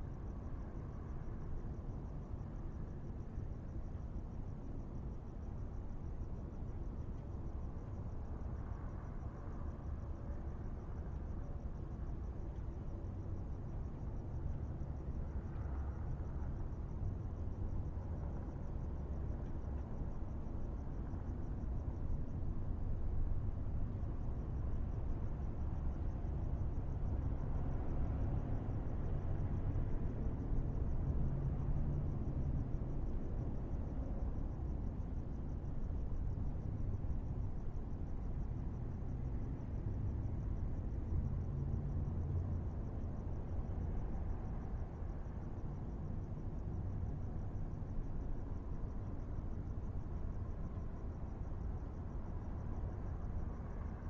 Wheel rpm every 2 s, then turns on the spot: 0, 0, 0, 0, 0, 0, 0, 0, 0, 0, 0, 0, 0, 0, 0, 0, 0, 0, 0, 0, 0, 0, 0, 0, 0, 0, 0.
none